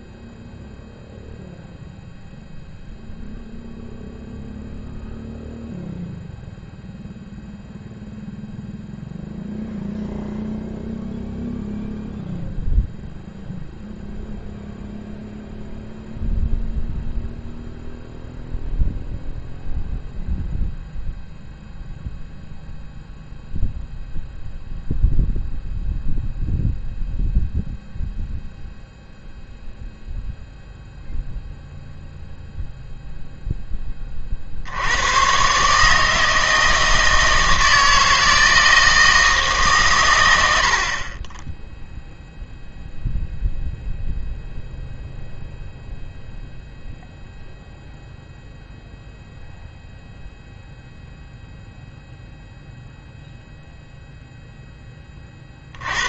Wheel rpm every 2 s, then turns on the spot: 0, 0, 0, 0, 0, 0, 0, 0, 0, 0, 0, 0, 0, 0, 0, 0, 0, 80, 160, 160, 70, 0, 0, 0, 0, 0, 0, 10.
none